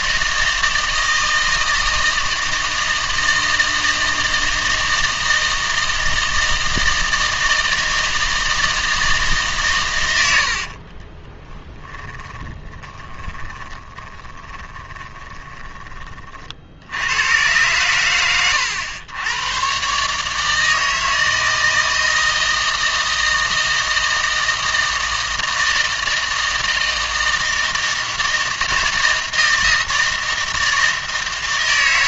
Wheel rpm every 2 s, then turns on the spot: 160, 160, 160, 160, 160, 60, 20, 20, 80, 100, 160, 160, 160, 160, 160, 160.
10-16